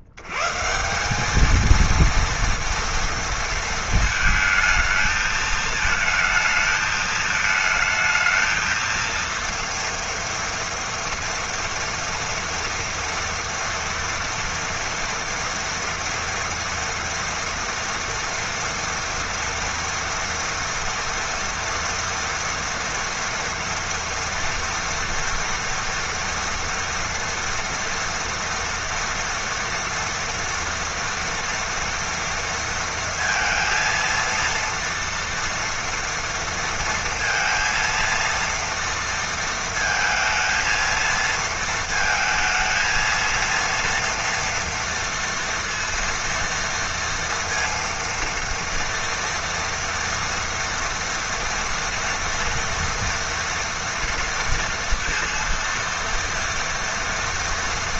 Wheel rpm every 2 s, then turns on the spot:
90, 230, 220, 220, 220, 230, 230, 230, 230, 230, 230, 230, 230, 240, 230, 230, 230, 230, 230, 230, 230, 220, 230, 230, 230, 230, 230, 230, 230.
none